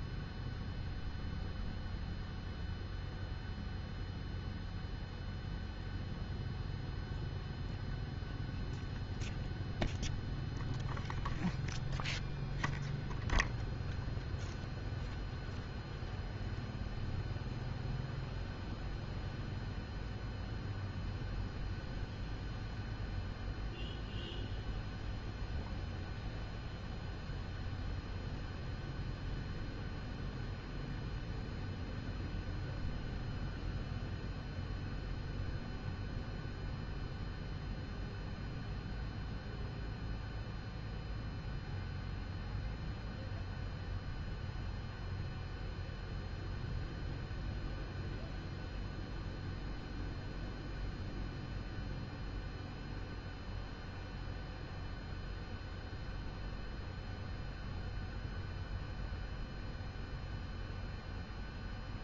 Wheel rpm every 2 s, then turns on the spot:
0, 0, 0, 0, 0, 0, 0, 0, 0, 0, 0, 0, 0, 0, 0, 0, 0, 0, 0, 0, 0, 0, 0, 0, 0, 0, 0, 0, 0, 0, 0.
none